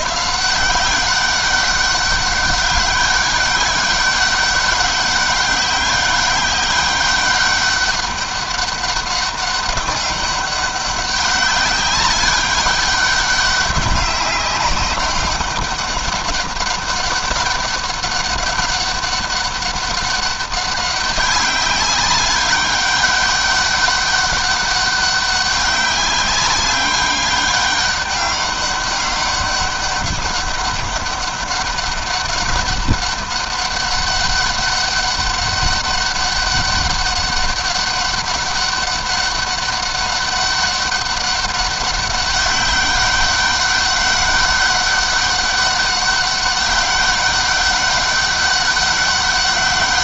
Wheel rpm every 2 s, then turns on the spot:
170, 200, 190, 200, 200, 190, 190, 190, 200, 200, 200, 200, 200, 190, 200, 200, 200, 200, 200, 200, 200, 200, 200, 200, 200.
none